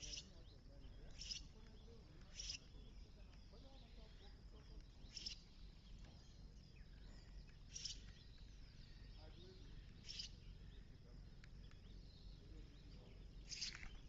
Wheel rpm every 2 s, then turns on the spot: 0, 0, 0, 0, 0, 0, 0.
none